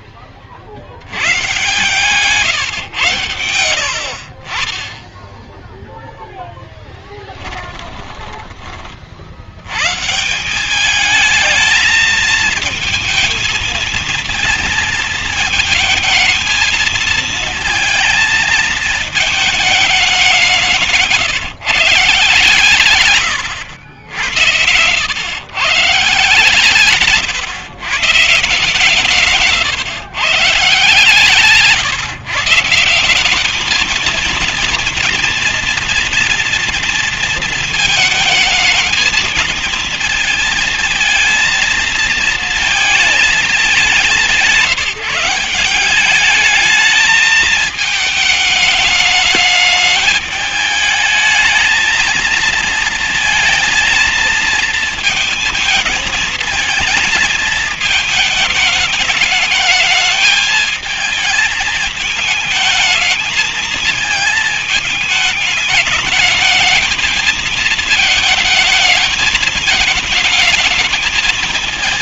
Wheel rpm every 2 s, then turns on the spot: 60, 140, 40, 10, 30, 200, 220, 230, 220, 220, 180, 130, 110, 150, 160, 150, 150, 230, 230, 220, 230, 220, 170, 210, 210, 210, 220, 230, 220, 220, 230, 220, 220, 220, 220, 210.
none